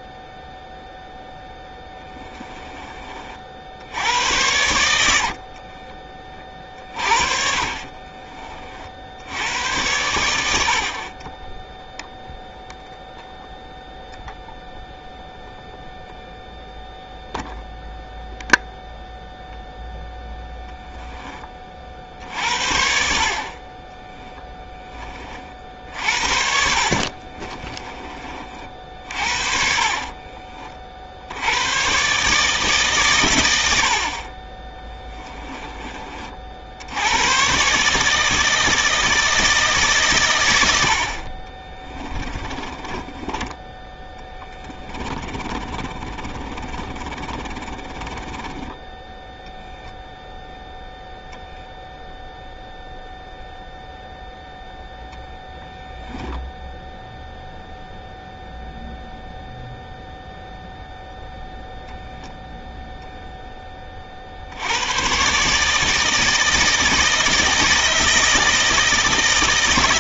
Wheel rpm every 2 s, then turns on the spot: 0, 20, 80, 40, 50, 60, 0, 0, 0, 0, 10, 70, 10, 60, 50, 40, 150, 20, 80, 160, 70, 20, 20, 20, 10, 0, 0, 0, 0, 0, 0, 0, 90, 160, 160.
6-8 26-30 34-36 42-48